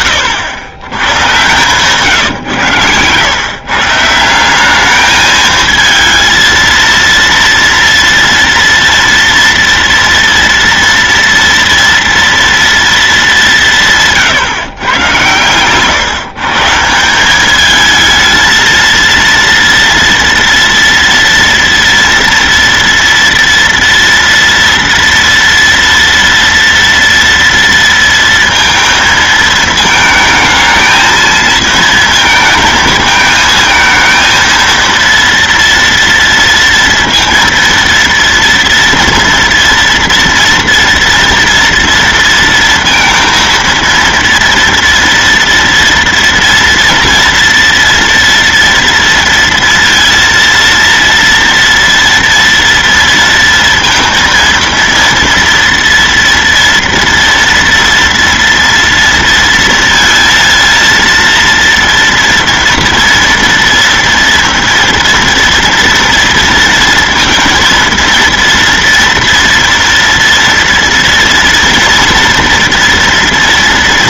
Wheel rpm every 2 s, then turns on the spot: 100, 110, 210, 230, 230, 230, 220, 130, 180, 230, 230, 230, 230, 230, 220, 220, 220, 230, 230, 230, 230, 230, 230, 240, 230, 230, 230, 230, 230, 230, 230, 230, 230, 230, 230, 230, 230.
none